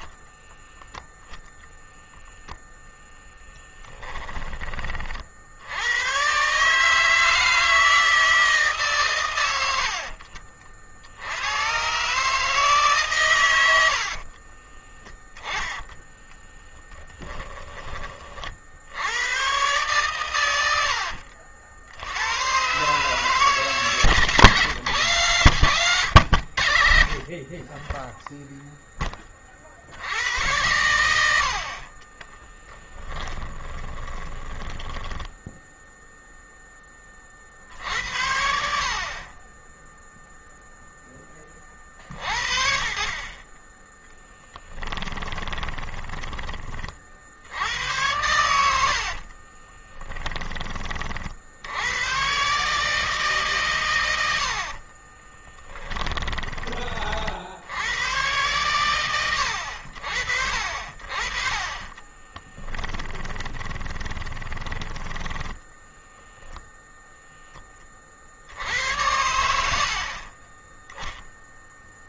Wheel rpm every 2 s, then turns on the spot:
0, 10, 40, 150, 130, 70, 130, 10, 10, 90, 70, 140, 140, 50, 20, 90, 20, 10, 30, 50, 10, 40, 20, 50, 60, 50, 150, 30, 40, 110, 50, 20, 10, 0, 80, 10.
14-18 20-22 32-36 44-46 48-50 54-56 62-66